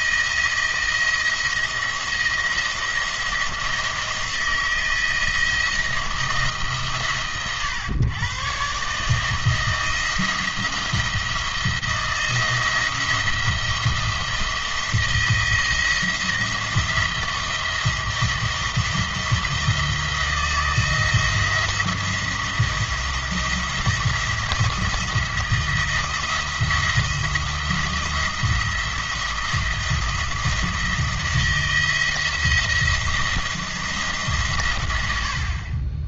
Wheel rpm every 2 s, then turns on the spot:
170, 170, 160, 140, 140, 170, 170, 170, 170, 170, 170, 170, 160, 170, 170, 170, 170, 100.
none